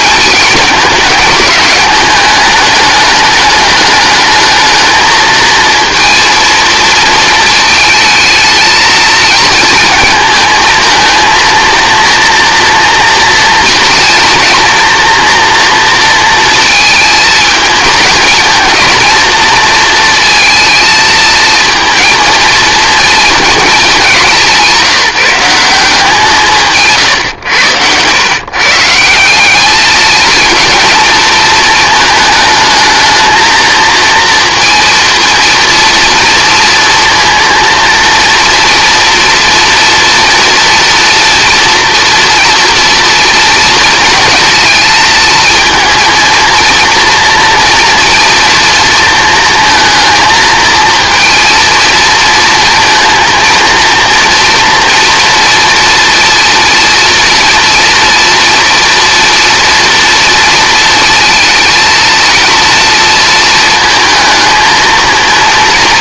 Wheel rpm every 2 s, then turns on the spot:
220, 210, 220, 230, 220, 220, 230, 240, 220, 230, 230, 230, 190, 160, 140, 220, 220, 230, 230, 230, 240, 230, 220, 230, 230, 220, 230, 230, 230, 230, 230, 230, 220.
none